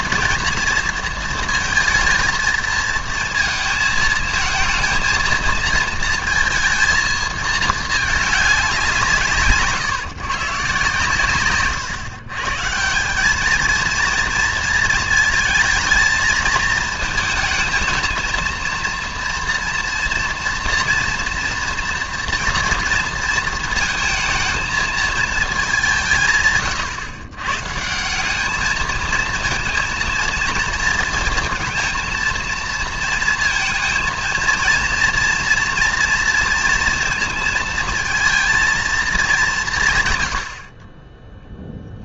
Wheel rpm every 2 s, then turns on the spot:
230, 230, 220, 230, 200, 140, 150, 230, 220, 230, 230, 230, 220, 140, 210, 230, 230, 230, 230, 230, 60.
none